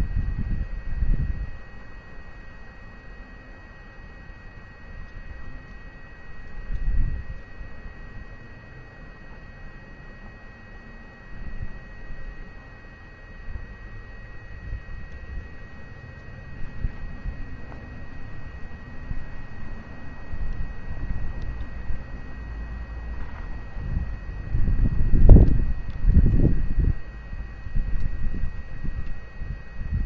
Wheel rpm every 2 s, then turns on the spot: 0, 0, 0, 0, 0, 0, 0, 0, 0, 0, 0, 0, 0, 0, 0.
none